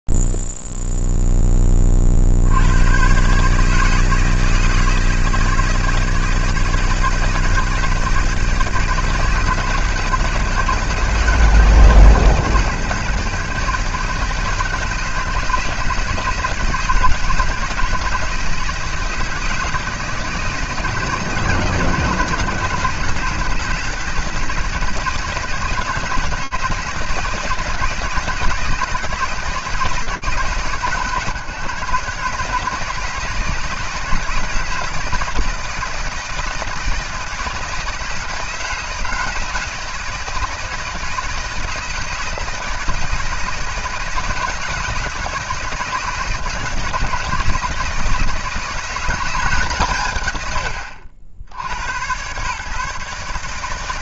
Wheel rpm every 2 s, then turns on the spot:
0, 40, 150, 160, 160, 160, 160, 160, 160, 160, 160, 160, 160, 160, 170, 140, 150, 160, 160, 160, 160, 160, 160, 160, 170, 90, 140.
none